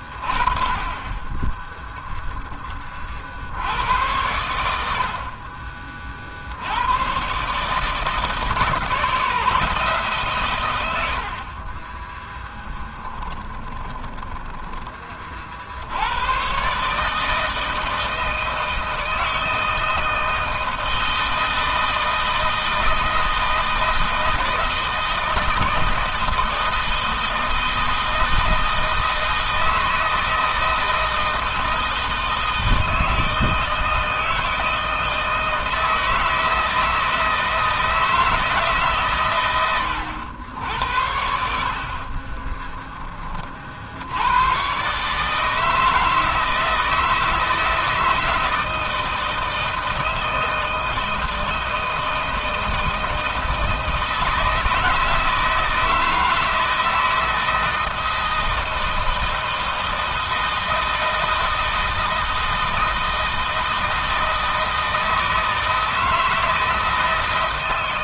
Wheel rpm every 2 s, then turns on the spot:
20, 20, 70, 100, 160, 90, 20, 20, 150, 160, 160, 160, 160, 160, 160, 160, 160, 160, 160, 140, 80, 20, 130, 160, 160, 160, 160, 160, 160, 160, 160, 160, 160, 160.
0-2 12-14